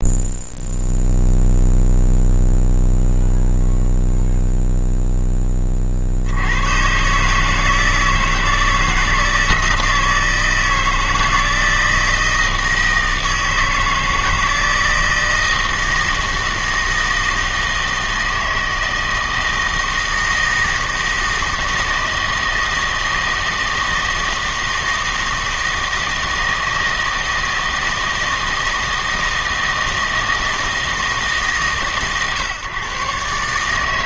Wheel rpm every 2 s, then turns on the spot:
0, 0, 0, 100, 160, 160, 160, 160, 160, 160, 160, 160, 160, 160, 160, 160, 130.
none